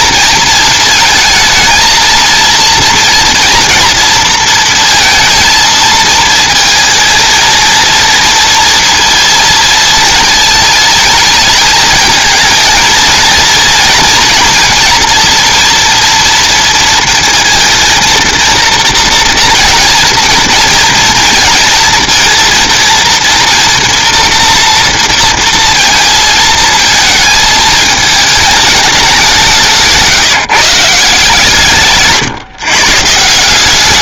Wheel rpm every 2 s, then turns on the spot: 230, 230, 230, 220, 230, 220, 220, 230, 230, 230, 230, 230, 230, 220, 210, 160, 130.
none